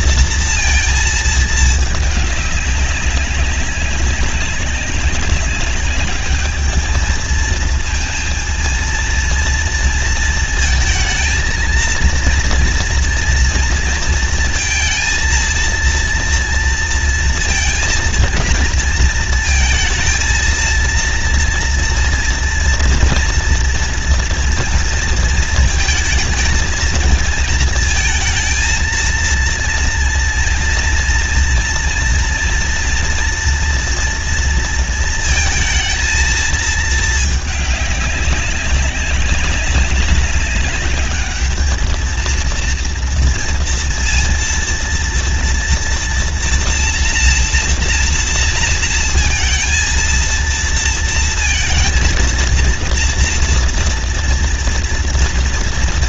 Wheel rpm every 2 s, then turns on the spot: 230, 200, 190, 210, 230, 220, 230, 230, 230, 230, 230, 240, 230, 220, 230, 230, 230, 230, 220, 190, 200, 230, 230, 240, 230, 230, 230, 230.
none